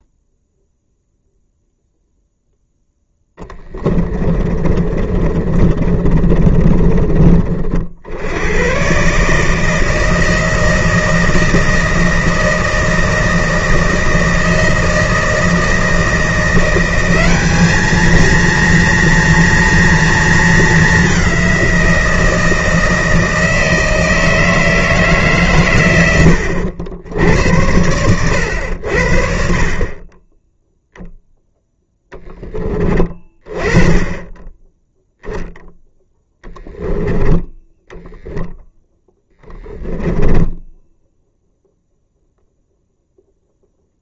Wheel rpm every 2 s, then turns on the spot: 0, 10, 30, 30, 130, 160, 160, 160, 190, 230, 200, 160, 150, 90, 80, 0, 20, 0, 10, 0, 0, 0.
2-6